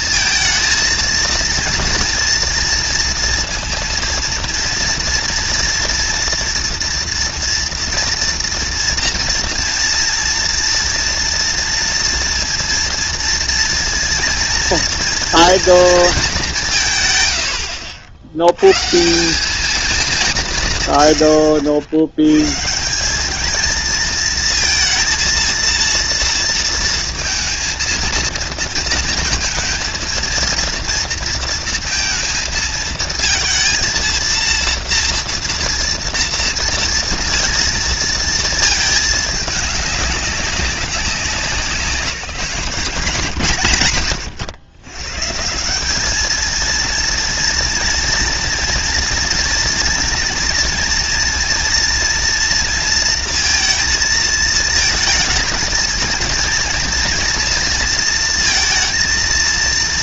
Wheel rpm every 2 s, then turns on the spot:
230, 230, 230, 230, 230, 230, 230, 230, 180, 100, 170, 110, 230, 230, 230, 230, 220, 230, 230, 220, 200, 170, 130, 220, 230, 230, 230, 220, 230, 230.
none